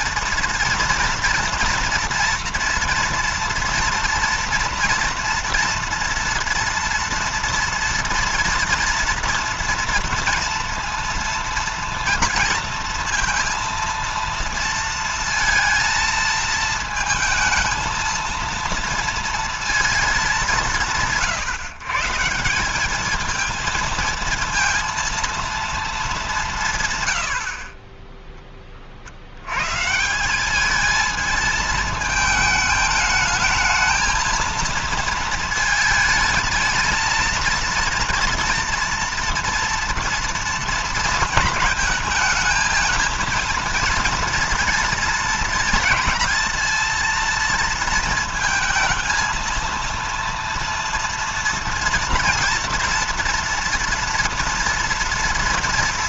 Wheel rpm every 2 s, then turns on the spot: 230, 230, 240, 230, 230, 230, 230, 230, 220, 230, 160, 210, 230, 120, 60, 220, 220, 220, 230, 230, 230, 220, 230, 230, 230, 230, 230, 240.
none